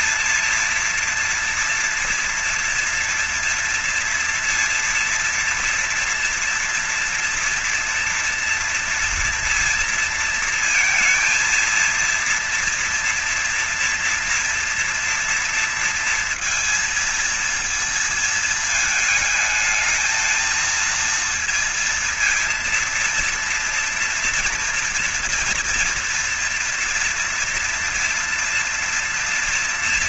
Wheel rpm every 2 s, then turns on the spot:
230, 230, 230, 230, 230, 230, 230, 230, 230, 220, 220, 230, 230, 230, 230.
none